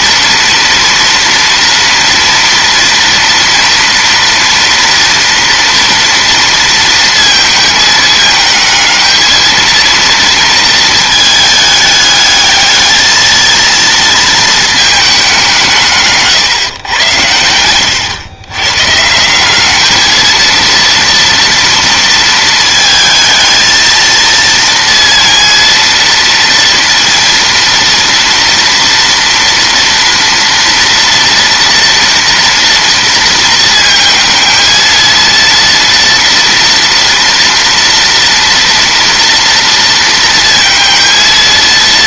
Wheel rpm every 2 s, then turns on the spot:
230, 230, 230, 230, 220, 230, 220, 220, 120, 130, 230, 220, 230, 230, 230, 230, 230, 230, 230, 230, 230.
none